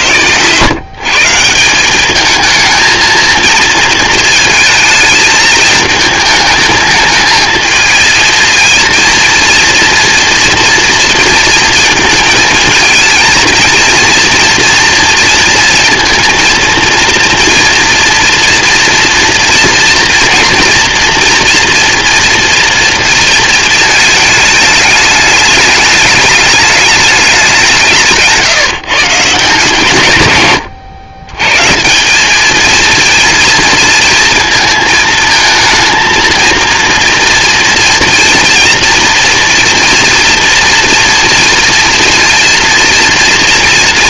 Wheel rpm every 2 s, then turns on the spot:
140, 230, 220, 220, 230, 230, 230, 230, 230, 240, 230, 230, 210, 210, 140, 100, 230, 220, 230, 230, 230, 240.
none